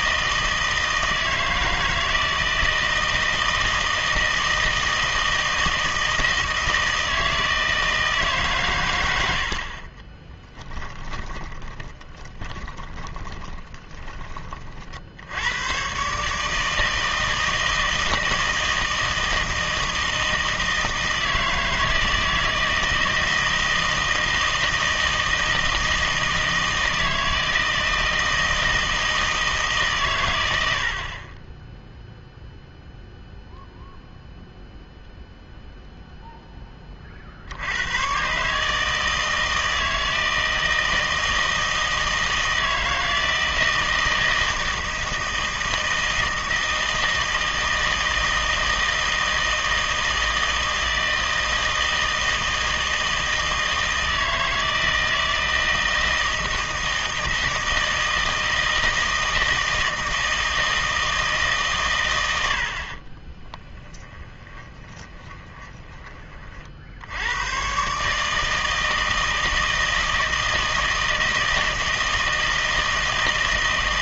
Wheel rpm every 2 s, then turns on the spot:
160, 160, 160, 160, 120, 10, 10, 50, 160, 160, 160, 160, 160, 160, 160, 80, 0, 0, 20, 150, 160, 160, 160, 160, 160, 160, 160, 160, 160, 160, 160, 70, 20, 60, 160, 160, 160.
10-14 64-66